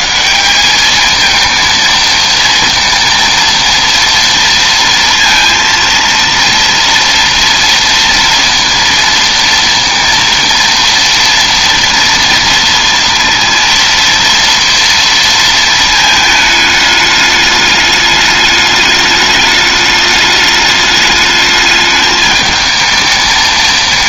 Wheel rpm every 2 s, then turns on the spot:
210, 230, 230, 230, 230, 230, 230, 230, 210, 210, 210, 220.
none